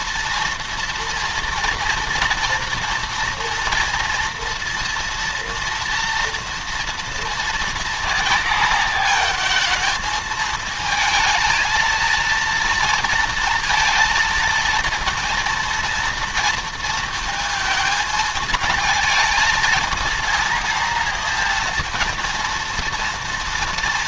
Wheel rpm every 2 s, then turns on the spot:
230, 230, 230, 230, 230, 220, 230, 230, 230, 220, 230, 230.
none